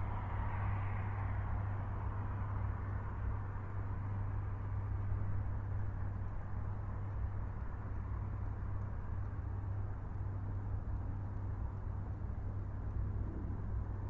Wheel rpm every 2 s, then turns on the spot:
0, 0, 0, 0, 0, 0, 0.
none